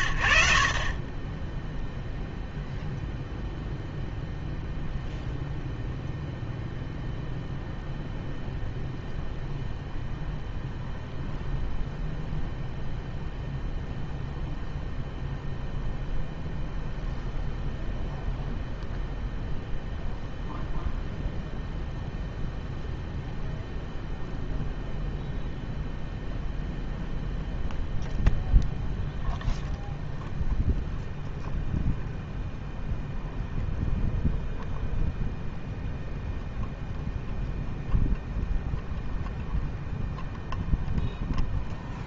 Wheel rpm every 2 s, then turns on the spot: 70, 0, 0, 0, 0, 0, 0, 0, 0, 0, 0, 0, 0, 0, 0, 0, 0, 0, 0, 0, 0.
none